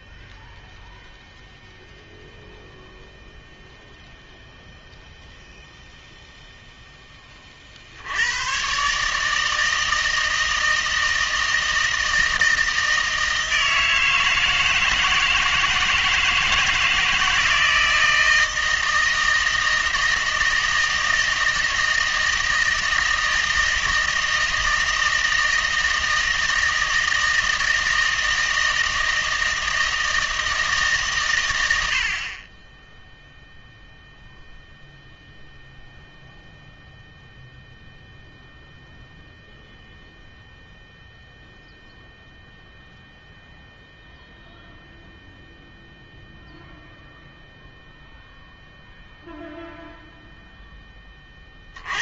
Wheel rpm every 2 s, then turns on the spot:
0, 0, 0, 0, 140, 160, 160, 160, 160, 160, 160, 160, 160, 160, 160, 150, 10, 0, 0, 0, 0, 0, 0, 0, 0, 10.
none